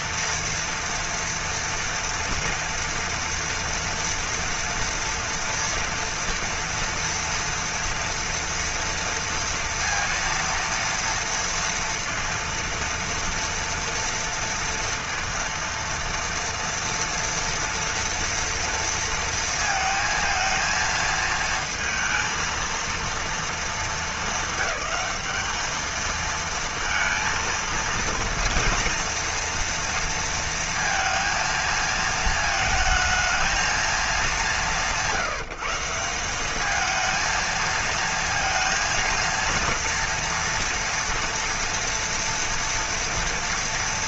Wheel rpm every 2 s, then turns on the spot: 230, 230, 230, 230, 230, 230, 230, 230, 230, 230, 220, 230, 220, 230, 230, 230, 220, 200, 190, 230, 230, 230.
none